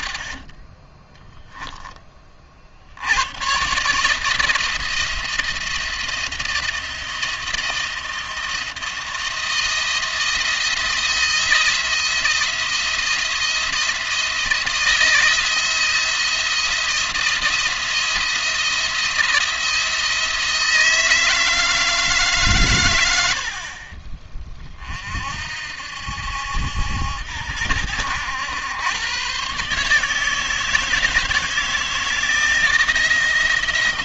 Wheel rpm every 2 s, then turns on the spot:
30, 80, 170, 170, 170, 170, 170, 170, 170, 170, 160, 110, 40, 80, 110, 160, 170.
0-2